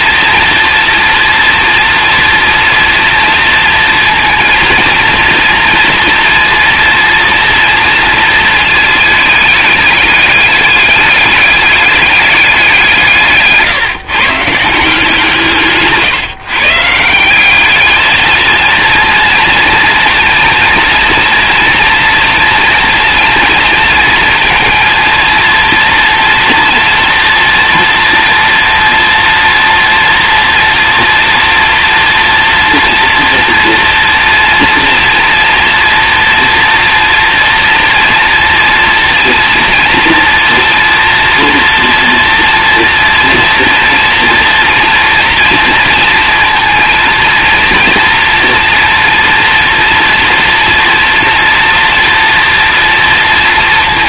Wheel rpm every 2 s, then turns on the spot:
240, 230, 230, 230, 220, 210, 190, 150, 150, 230, 230, 240, 230, 230, 230, 230, 230, 230, 240, 240, 240, 240, 230, 230, 230, 240, 230.
none